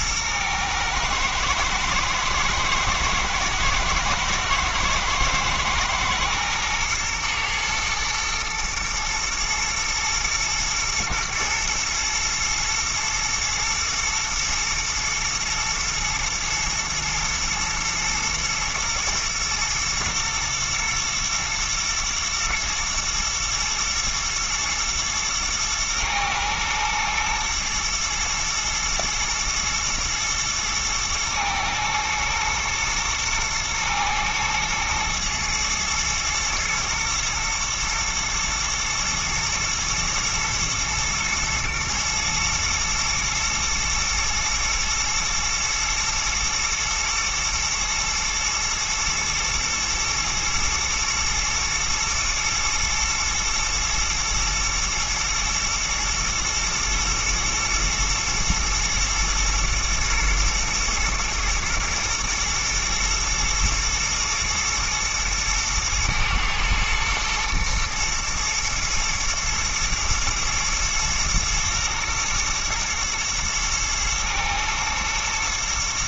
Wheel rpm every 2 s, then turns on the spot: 110, 110, 110, 110, 110, 120, 110, 110, 110, 110, 110, 120, 120, 110, 110, 110, 110, 110, 110, 120, 120, 110, 120, 110, 120, 110, 110, 120, 110, 110, 120, 110, 110, 110, 120, 120, 110, 110.
none